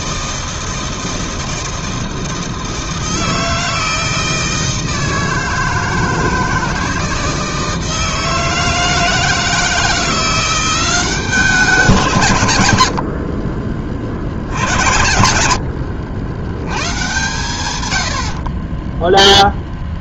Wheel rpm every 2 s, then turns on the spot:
160, 160, 160, 160, 160, 180, 110, 70, 110, 20.
none